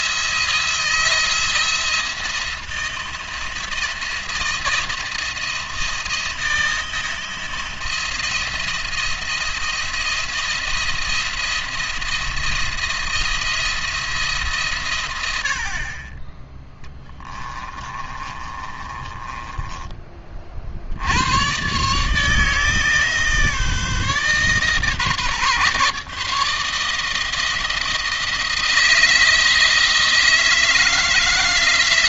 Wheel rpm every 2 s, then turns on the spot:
170, 160, 170, 170, 170, 170, 170, 140, 20, 30, 50, 160, 140, 160, 160, 160.
16-20